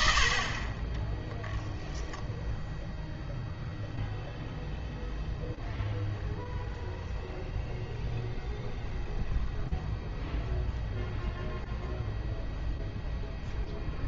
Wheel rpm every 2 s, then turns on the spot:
30, 0, 0, 0, 0, 0, 0.
none